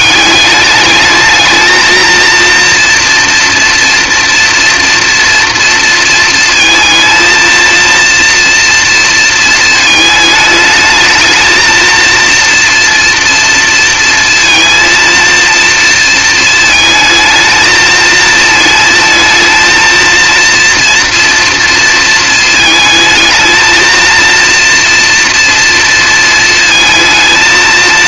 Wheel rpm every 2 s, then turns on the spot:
210, 230, 230, 230, 230, 220, 230, 230, 220, 220, 240, 220, 230, 220.
none